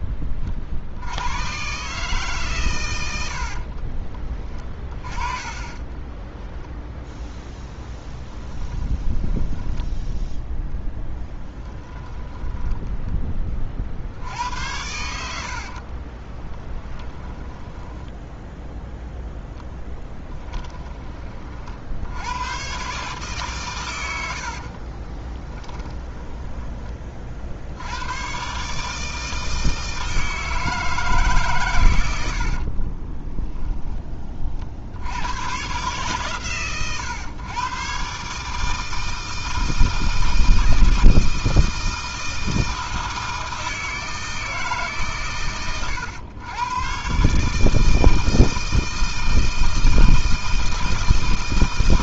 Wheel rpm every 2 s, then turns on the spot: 50, 120, 20, 20, 20, 10, 10, 90, 10, 0, 20, 130, 50, 20, 140, 160, 50, 50, 130, 150, 160, 160, 150, 120, 160, 160.
4-14 16-18 20-22 24-28 32-34